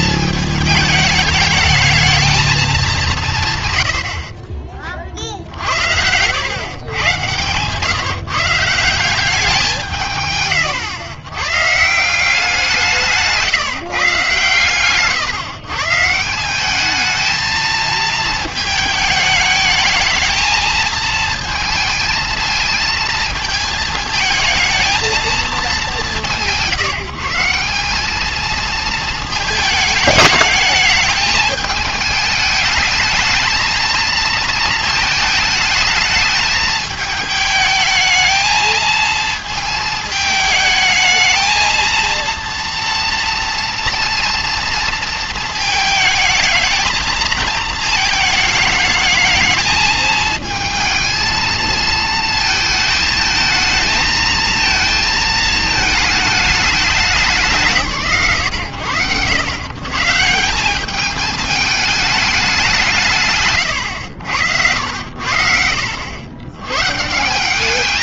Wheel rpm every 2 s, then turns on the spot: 220, 210, 30, 110, 160, 140, 180, 130, 200, 220, 220, 220, 220, 150, 220, 210, 210, 220, 220, 220, 210, 230, 230, 220, 220, 220, 220, 230, 220, 100, 190, 180, 80, 120.
none